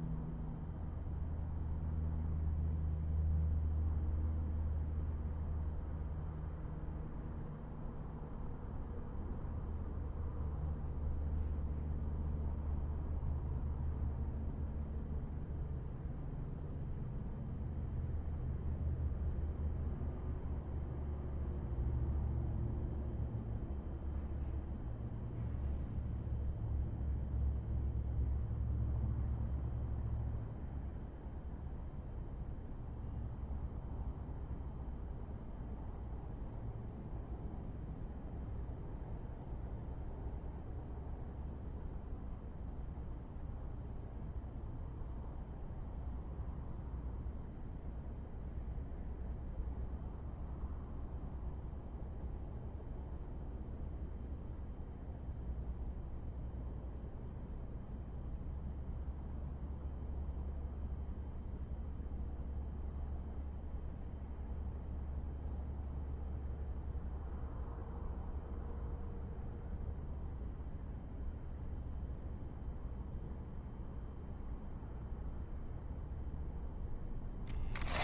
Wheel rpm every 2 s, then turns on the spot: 0, 0, 0, 0, 0, 0, 0, 0, 0, 0, 0, 0, 0, 0, 0, 0, 0, 0, 0, 0, 0, 0, 0, 0, 0, 0, 0, 0, 0, 0, 0, 0, 0, 0, 0, 0, 0, 0, 0.
none